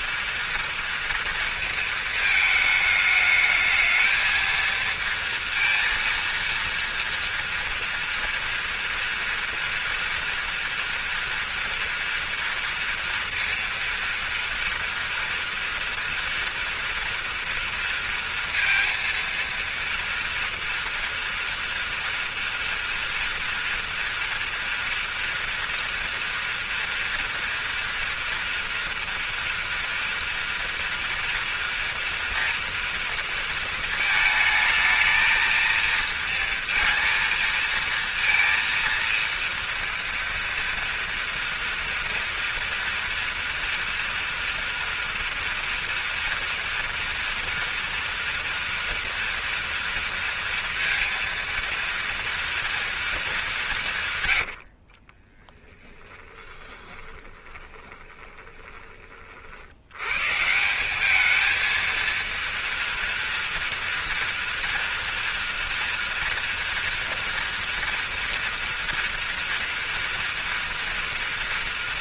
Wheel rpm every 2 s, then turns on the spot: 230, 220, 220, 230, 230, 230, 230, 230, 230, 230, 230, 230, 230, 230, 230, 230, 230, 220, 230, 230, 230, 240, 230, 230, 230, 230, 230, 130, 10, 20, 130, 230, 230, 230, 230, 240.
56-60